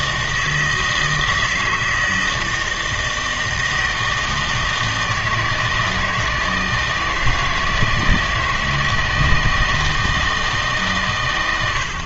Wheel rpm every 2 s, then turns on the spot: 160, 160, 160, 160, 160, 150.
none